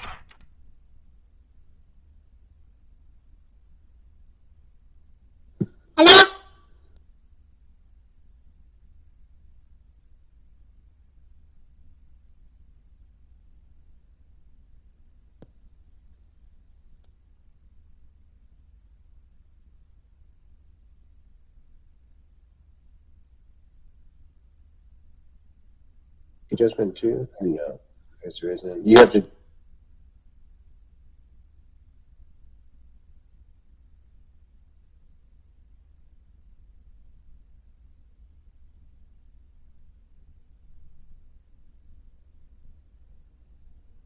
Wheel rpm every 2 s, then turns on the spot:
10, 0, 0, 0, 0, 0, 0, 0, 0, 0, 0, 0, 0, 0, 0, 0, 0, 0, 0, 0, 0, 0.
none